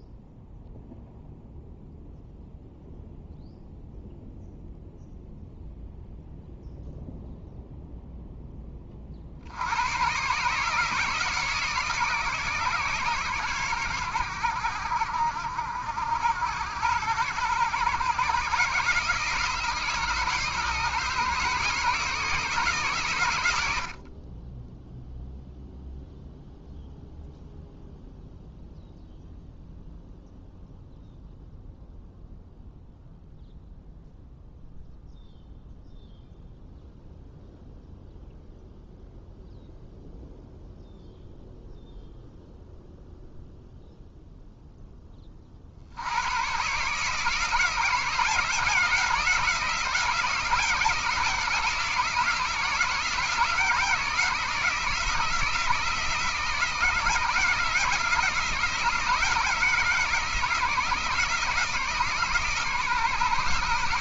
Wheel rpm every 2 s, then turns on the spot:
0, 0, 0, 0, 10, 140, 140, 90, 70, 130, 150, 150, 10, 0, 0, 0, 0, 0, 0, 0, 0, 0, 0, 120, 160, 170, 160, 160, 160, 160, 160, 150.
none